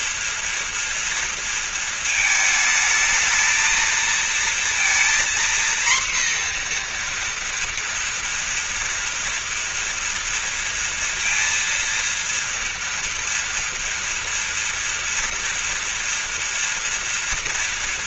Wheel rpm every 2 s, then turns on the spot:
230, 220, 230, 240, 230, 230, 230, 240, 230.
none